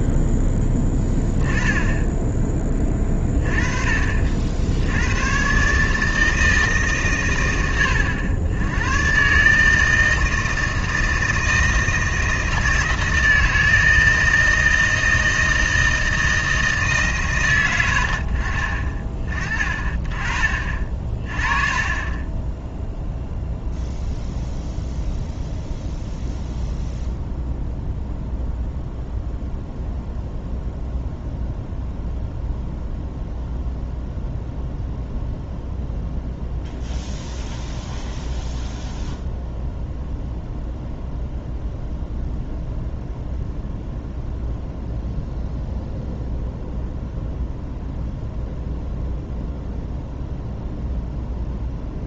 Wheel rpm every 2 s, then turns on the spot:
10, 20, 60, 150, 100, 160, 160, 160, 160, 40, 40, 10, 0, 0, 0, 0, 0, 0, 0, 0, 0, 0, 0, 0, 0, 0.
none